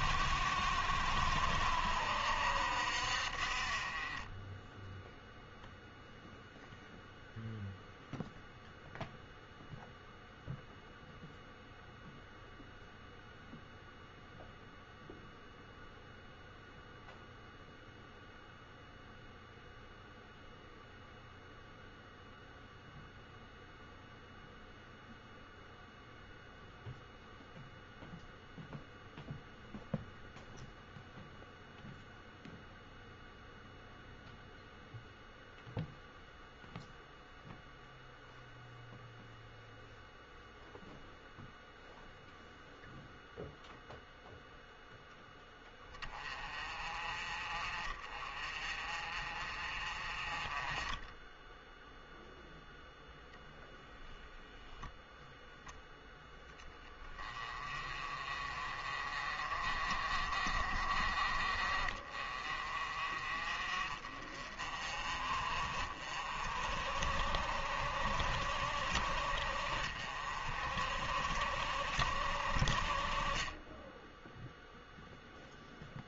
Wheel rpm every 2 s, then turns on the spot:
70, 60, 10, 0, 0, 0, 0, 0, 0, 0, 0, 0, 0, 0, 0, 0, 0, 0, 0, 0, 0, 0, 0, 30, 40, 20, 0, 0, 20, 30, 40, 40, 40, 50, 50, 50, 40, 0.
none